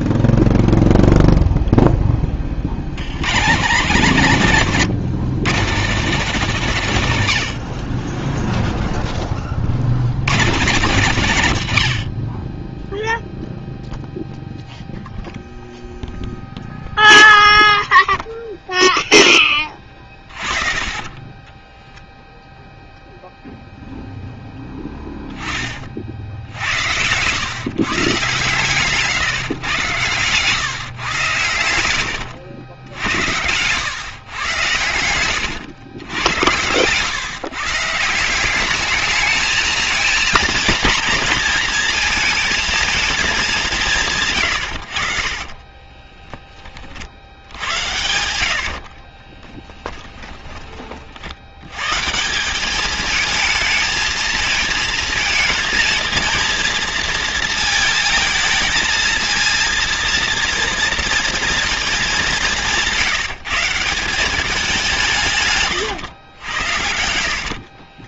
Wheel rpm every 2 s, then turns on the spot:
0, 80, 170, 180, 0, 190, 10, 0, 0, 0, 30, 0, 10, 80, 140, 140, 80, 110, 110, 210, 230, 220, 90, 40, 60, 30, 210, 230, 230, 220, 230, 170, 180, 80.
20-22 24-26 48-50 66-68